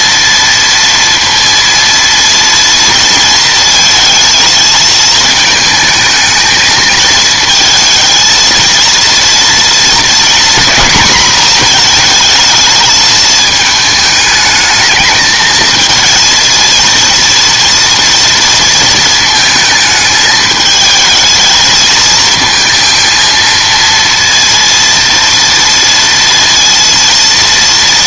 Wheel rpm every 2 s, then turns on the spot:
230, 230, 220, 220, 230, 230, 220, 220, 230, 230, 220, 230, 230, 230.
none